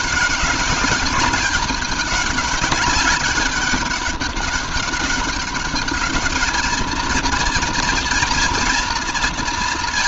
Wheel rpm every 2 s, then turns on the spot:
200, 200, 200, 210, 230.
none